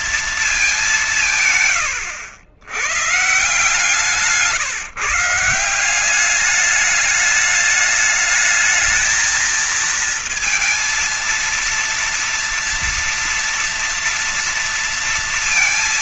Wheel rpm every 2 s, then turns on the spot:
200, 100, 150, 200, 220, 230, 240, 230.
none